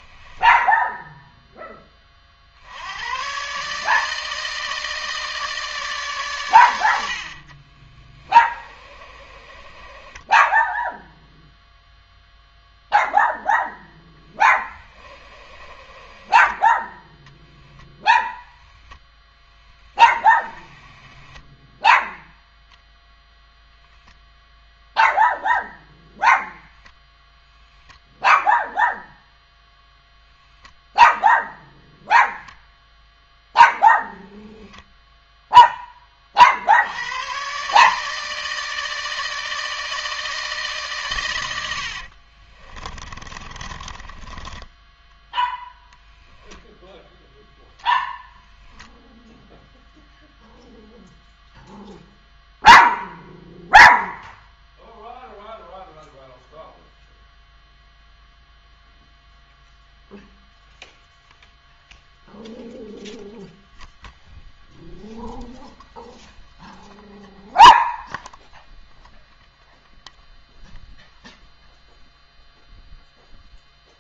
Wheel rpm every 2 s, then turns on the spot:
10, 50, 160, 120, 20, 10, 0, 10, 10, 0, 10, 0, 0, 0, 0, 0, 0, 10, 50, 160, 160, 40, 20, 10, 10, 0, 0, 0, 0, 0, 0, 0, 0, 0, 0, 0, 0.
0-2 8-12 14-18 34-36 42-46 48-50